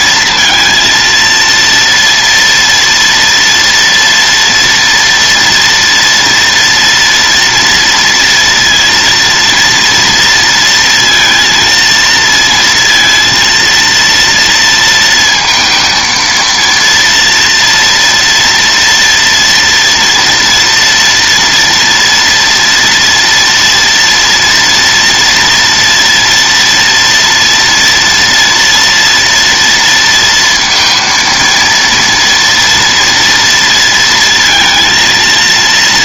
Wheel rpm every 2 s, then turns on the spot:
230, 230, 230, 230, 230, 230, 230, 230, 230, 230, 230, 240, 230, 230, 230, 230, 230, 230.
none